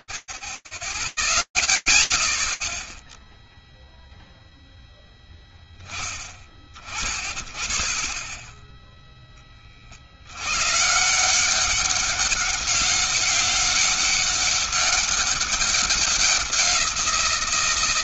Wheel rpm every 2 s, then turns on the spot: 0, 0, 0, 30, 20, 140, 200, 200, 180.
none